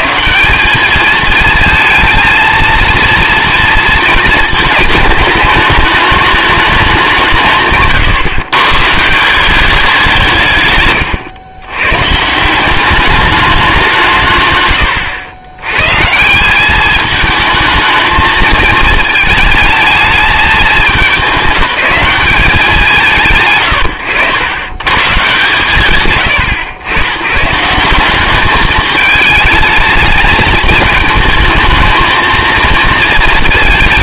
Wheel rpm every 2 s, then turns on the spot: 190, 220, 220, 210, 130, 150, 180, 120, 190, 230, 210, 180, 140, 120, 210, 210, 220.
none